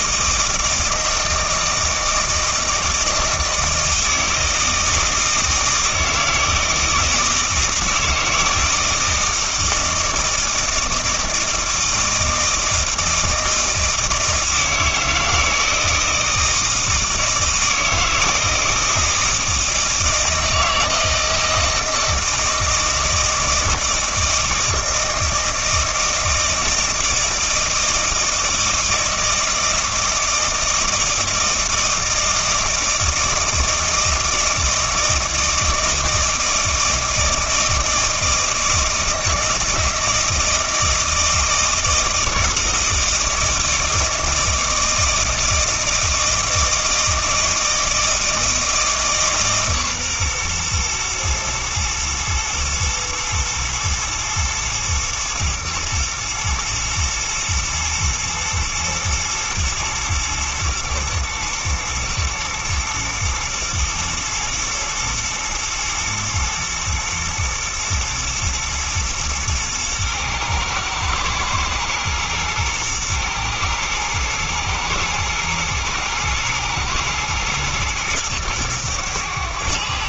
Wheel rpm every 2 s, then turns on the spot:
160, 160, 160, 160, 160, 160, 160, 160, 160, 160, 160, 160, 160, 160, 160, 160, 160, 160, 160, 160, 160, 160, 160, 160, 160, 120, 120, 120, 120, 110, 120, 110, 110, 110, 120, 110, 110, 110, 110, 110.
none